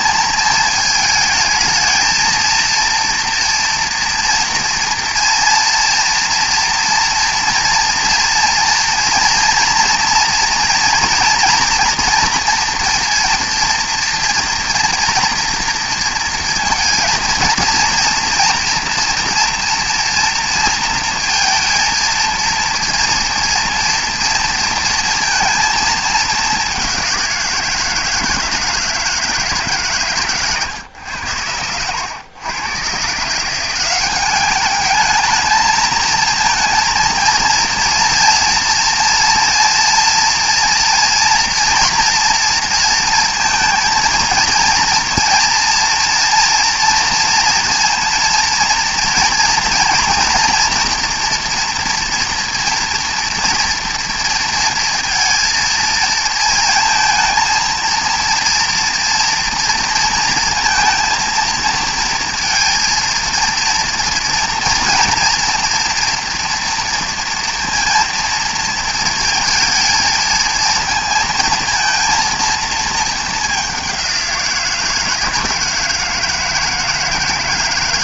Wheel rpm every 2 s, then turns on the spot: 230, 230, 230, 230, 230, 230, 230, 230, 230, 230, 230, 230, 230, 190, 160, 110, 140, 210, 230, 240, 240, 230, 230, 230, 230, 230, 230, 230, 230, 240, 230, 230, 230, 230, 230, 230, 220, 160, 160.
none